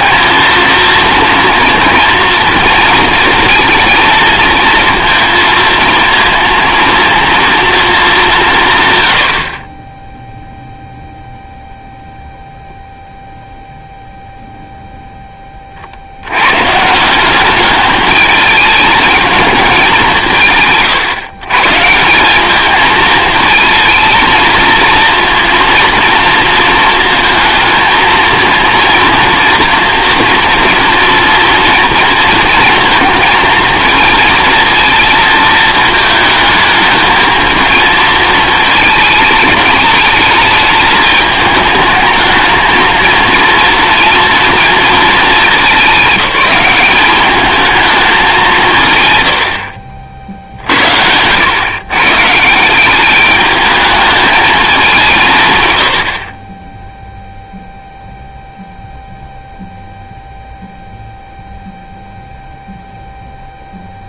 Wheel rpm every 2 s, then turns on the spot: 230, 230, 230, 230, 160, 0, 0, 0, 140, 210, 160, 210, 230, 230, 230, 230, 230, 230, 220, 220, 210, 220, 230, 200, 170, 60, 180, 200, 10, 0, 0, 0.
none